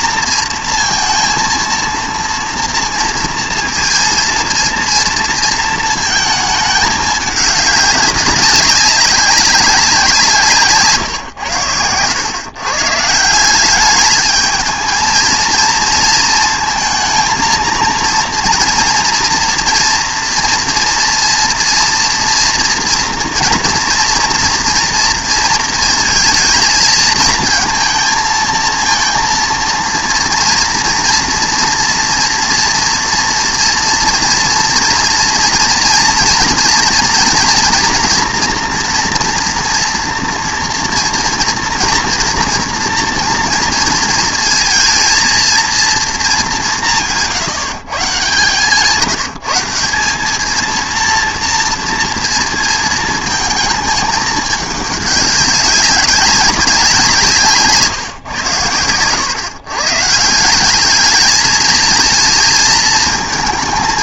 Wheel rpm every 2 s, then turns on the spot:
230, 230, 230, 220, 200, 140, 140, 220, 230, 230, 230, 230, 230, 230, 230, 230, 230, 230, 230, 230, 230, 240, 230, 190, 150, 230, 220, 210, 180, 100, 190, 220.
none